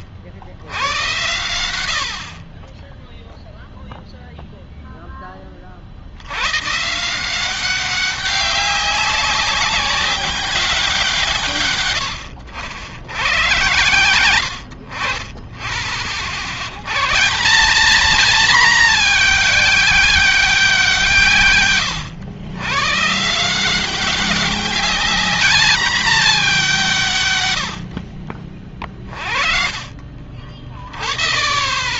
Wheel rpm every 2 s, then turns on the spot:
70, 30, 0, 100, 190, 200, 90, 100, 70, 220, 190, 110, 190, 200, 40, 40.
12-14